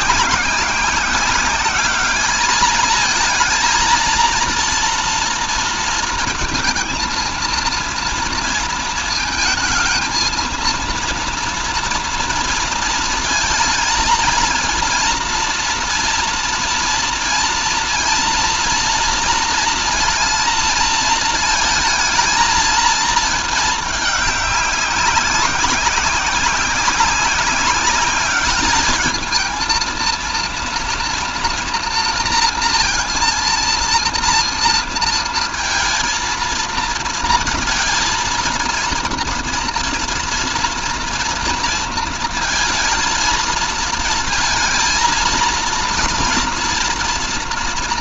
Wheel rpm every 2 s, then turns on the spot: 190, 220, 230, 230, 220, 230, 230, 230, 230, 230, 230, 220, 200, 190, 210, 230, 230, 230, 230, 230, 230, 230, 230, 230.
none